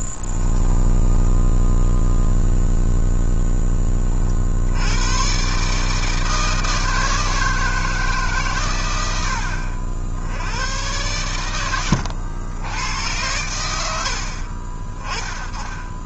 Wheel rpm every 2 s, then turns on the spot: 10, 0, 20, 150, 160, 70, 100, 70.
0-2